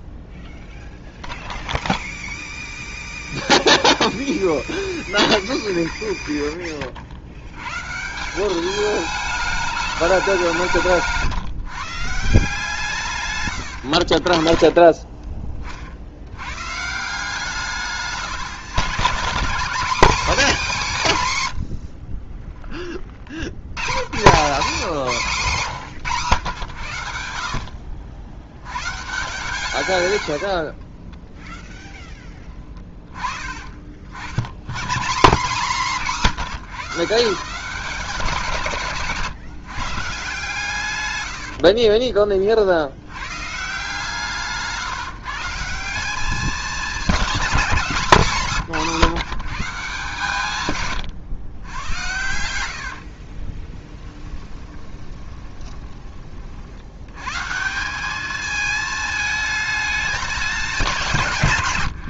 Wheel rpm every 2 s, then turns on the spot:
0, 0, 0, 30, 210, 170, 150, 30, 140, 140, 220, 20, 180, 90, 110, 40, 10, 120, 160, 160, 130, 60, 160, 200, 180, 140, 80, 20, 70, 220, 190.
10-12 14-16 30-32 52-56